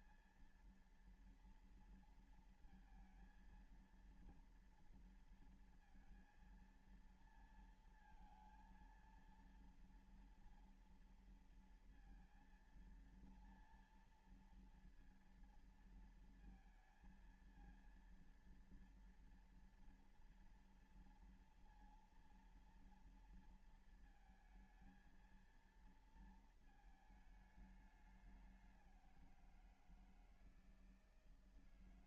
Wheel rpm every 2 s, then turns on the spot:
230, 230, 230, 220, 230, 230, 230, 230, 230, 230, 230, 230, 230, 230, 200, 160.
none